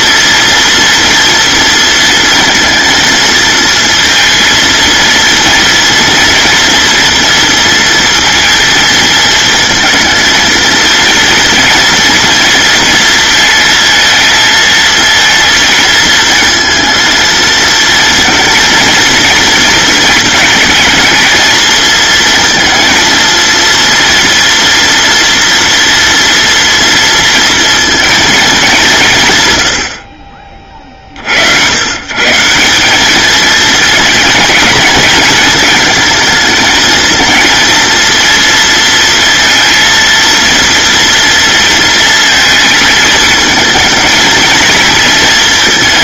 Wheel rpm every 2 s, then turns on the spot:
230, 230, 230, 240, 230, 230, 230, 230, 230, 230, 220, 230, 230, 230, 170, 50, 190, 210, 230, 230, 230, 220, 230.
none